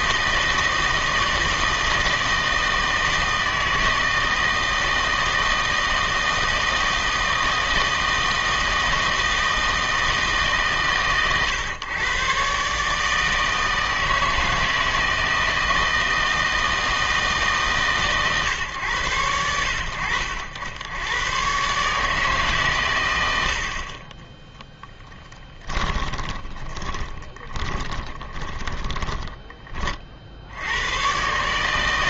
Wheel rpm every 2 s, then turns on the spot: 160, 160, 160, 160, 160, 140, 140, 160, 160, 130, 90, 130, 10, 20, 20, 80.
26-30